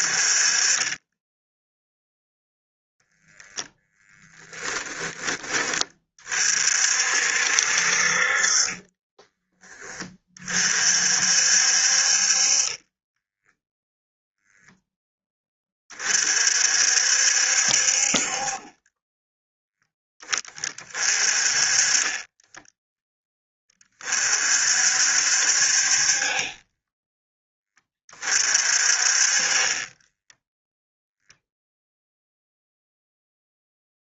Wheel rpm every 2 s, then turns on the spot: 20, 0, 10, 50, 20, 50, 20, 10, 60, 10, 30, 10, 60, 10, 40, 0, 0.
8-10 18-20 26-28